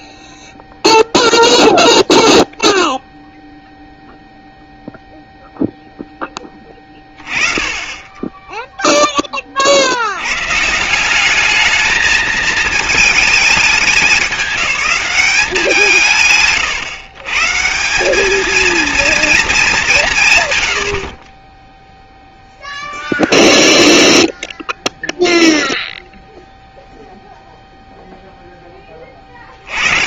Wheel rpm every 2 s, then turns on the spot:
0, 0, 0, 20, 10, 140, 220, 190, 130, 230, 90, 0, 0, 0, 10.
none